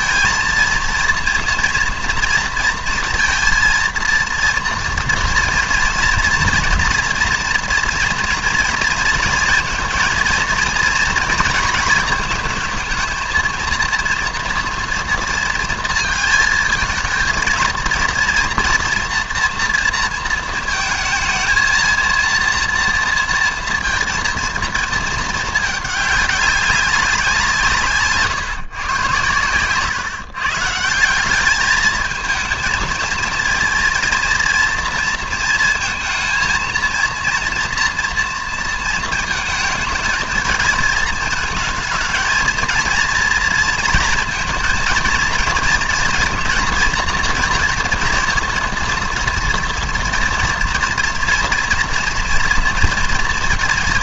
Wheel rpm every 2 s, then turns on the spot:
220, 230, 230, 230, 230, 230, 220, 230, 220, 230, 230, 230, 230, 200, 130, 140, 220, 230, 230, 230, 220, 230, 230, 230, 230, 230, 240.
none